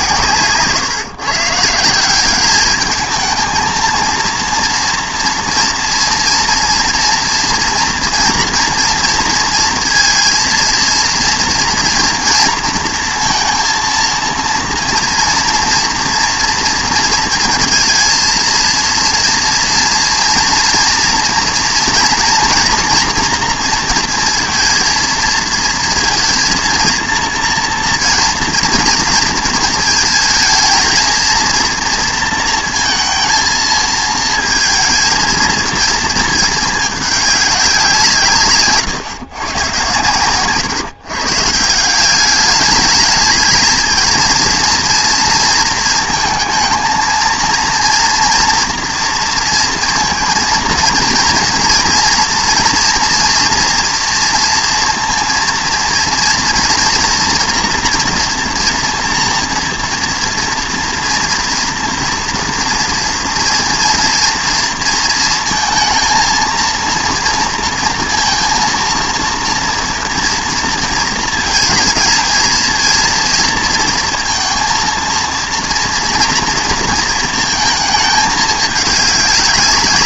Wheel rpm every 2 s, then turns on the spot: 140, 210, 230, 240, 230, 230, 230, 230, 230, 230, 230, 240, 230, 230, 230, 220, 230, 230, 210, 130, 130, 210, 230, 220, 230, 230, 230, 230, 230, 230, 240, 230, 230, 230, 230, 230, 230, 230, 230, 210.
none